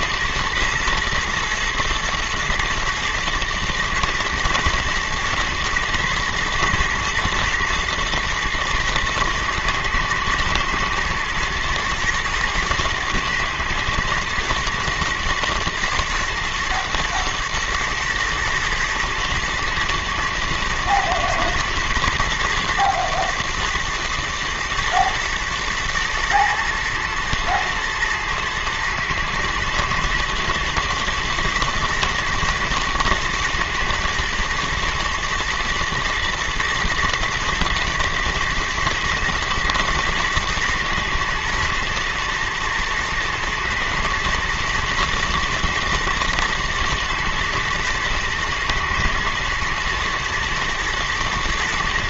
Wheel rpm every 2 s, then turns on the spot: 120, 120, 110, 120, 110, 110, 110, 110, 120, 110, 110, 110, 110, 110, 120, 120, 110, 120, 120, 110, 110, 110, 110, 120, 120, 120.
none